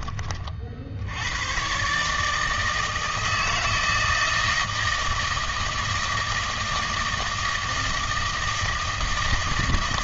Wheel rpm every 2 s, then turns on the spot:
50, 160, 160, 160, 160.
none